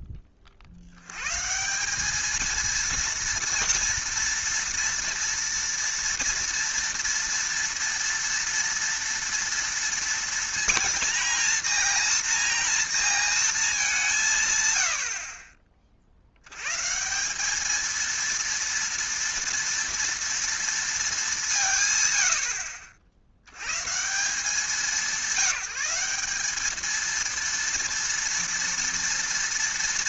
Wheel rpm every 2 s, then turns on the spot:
50, 220, 230, 230, 230, 230, 230, 110, 100, 230, 230, 60, 190, 200, 230.
none